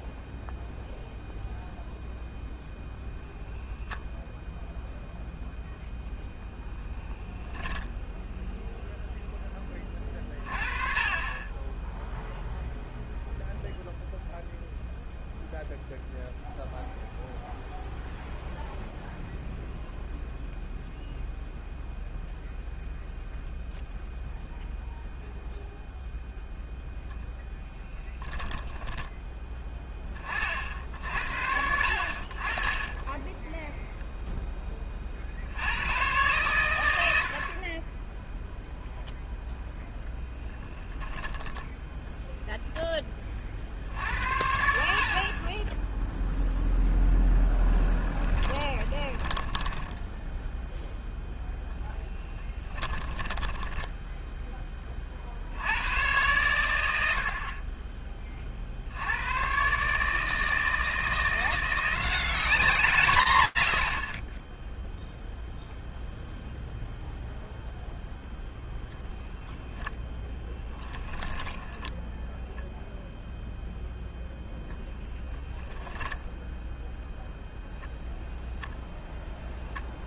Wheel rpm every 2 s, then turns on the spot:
0, 0, 0, 0, 0, 30, 0, 0, 0, 0, 0, 0, 0, 0, 10, 60, 30, 20, 100, 0, 10, 0, 70, 0, 10, 0, 10, 10, 100, 50, 160, 180, 10, 0, 10, 10, 0, 0, 0, 0.
48-50 52-54 70-72